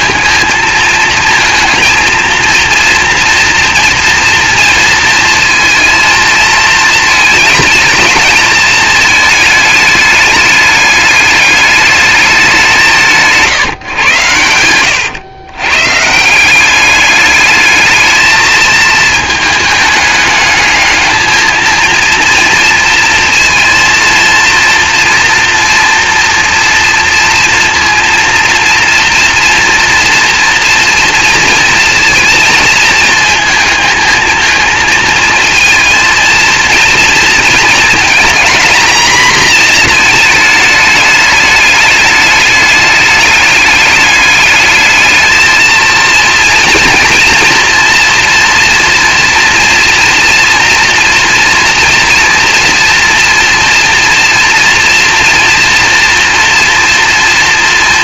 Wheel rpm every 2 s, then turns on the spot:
230, 230, 230, 220, 220, 210, 180, 110, 200, 220, 220, 230, 230, 230, 230, 230, 230, 230, 230, 230, 210, 210, 220, 230, 240, 230, 230, 230, 230.
none